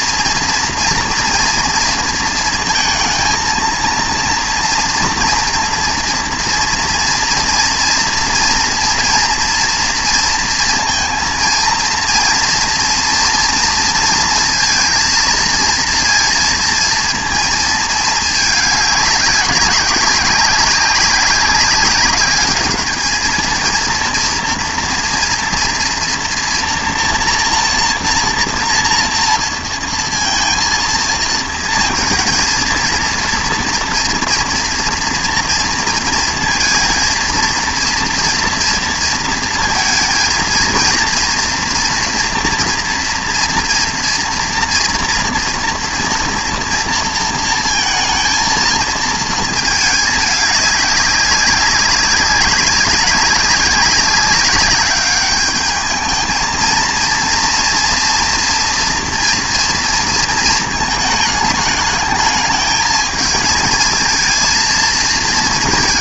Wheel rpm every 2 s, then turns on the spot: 230, 230, 230, 240, 230, 230, 230, 230, 230, 210, 200, 210, 230, 230, 230, 230, 230, 230, 230, 240, 230, 230, 230, 230, 230, 200, 190, 200, 220, 230, 220, 220, 230.
none